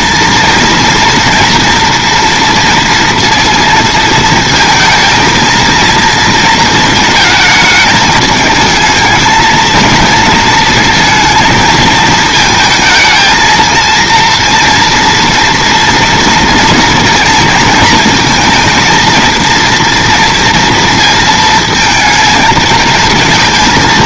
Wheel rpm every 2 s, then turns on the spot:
230, 230, 220, 220, 220, 230, 220, 240, 230, 230, 230, 230.
none